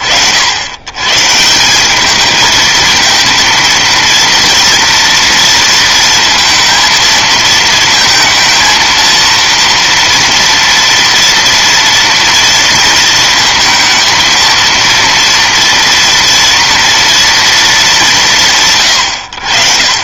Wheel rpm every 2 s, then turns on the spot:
110, 230, 230, 220, 230, 230, 220, 230, 230, 80.
none